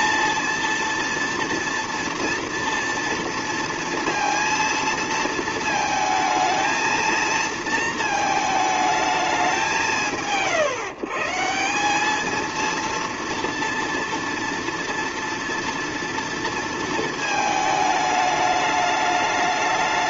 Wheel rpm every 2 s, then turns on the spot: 230, 230, 230, 220, 220, 120, 230, 230, 230, 210.
none